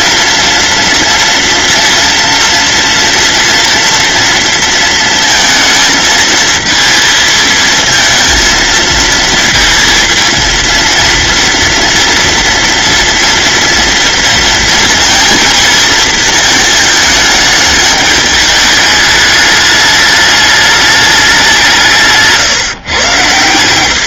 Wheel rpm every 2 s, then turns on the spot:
230, 230, 230, 220, 230, 230, 230, 220, 220, 210, 210, 130.
none